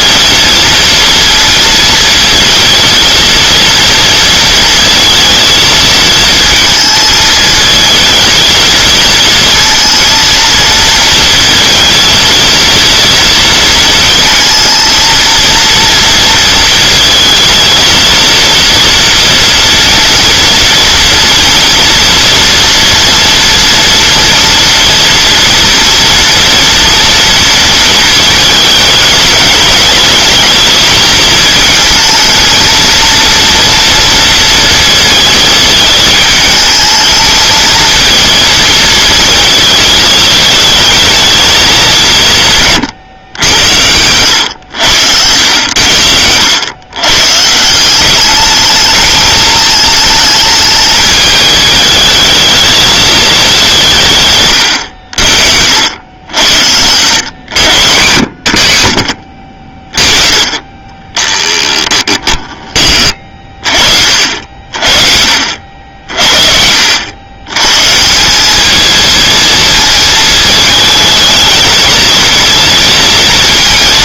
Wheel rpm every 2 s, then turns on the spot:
230, 230, 230, 220, 230, 230, 230, 230, 220, 230, 230, 230, 230, 230, 210, 220, 230, 230, 220, 230, 220, 140, 100, 120, 220, 210, 220, 80, 100, 100, 20, 20, 40, 80, 220, 220, 230.
60-62